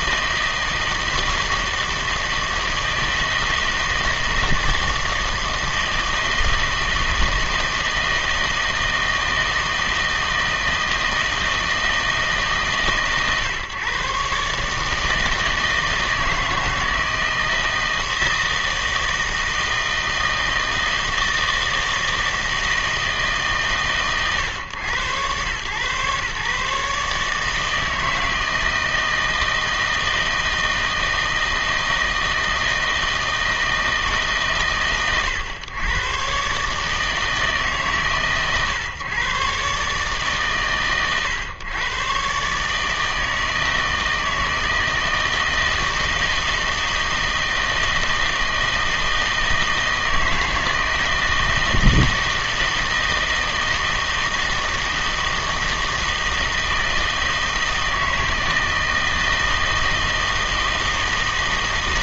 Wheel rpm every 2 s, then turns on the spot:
160, 160, 160, 160, 160, 160, 140, 150, 160, 160, 160, 160, 110, 140, 160, 160, 160, 130, 150, 130, 120, 150, 160, 160, 160, 160, 160, 160, 160, 160, 160.
none